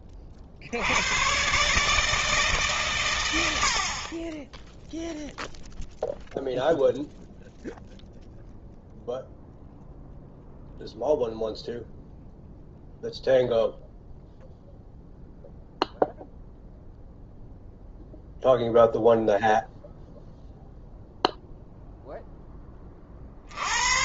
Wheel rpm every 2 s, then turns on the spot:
90, 130, 0, 0, 0, 0, 0, 0, 0, 0, 0, 30.
none